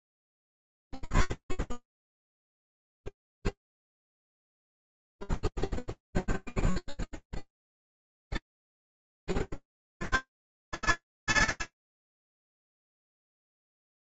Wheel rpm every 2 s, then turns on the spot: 0, 0, 0, 0, 0, 90, 90.
none